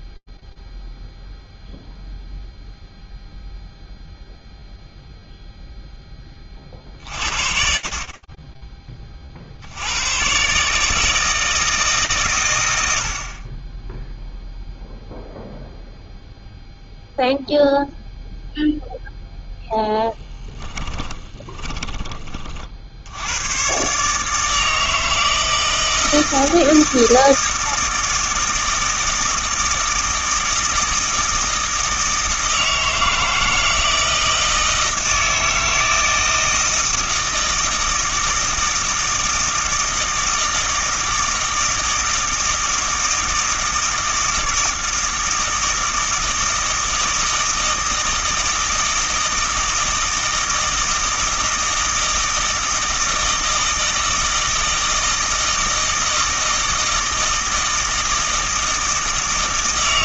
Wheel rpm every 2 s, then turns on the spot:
0, 0, 0, 10, 40, 130, 120, 0, 0, 0, 10, 60, 160, 160, 160, 160, 160, 160, 160, 160, 160, 160, 160, 160, 160, 160, 160, 160, 160, 160.
20-22